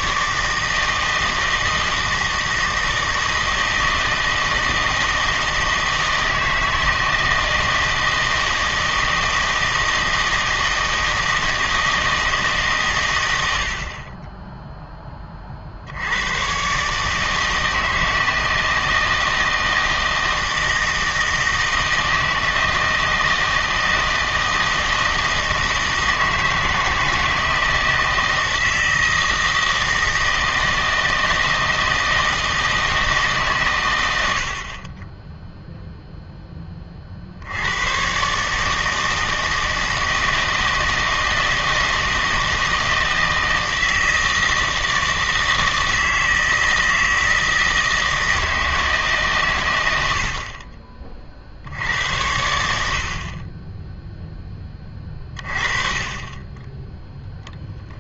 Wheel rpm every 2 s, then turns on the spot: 160, 160, 160, 160, 160, 160, 130, 0, 130, 160, 160, 160, 160, 160, 160, 160, 160, 40, 30, 150, 160, 160, 160, 160, 160, 40, 80, 20, 10.
none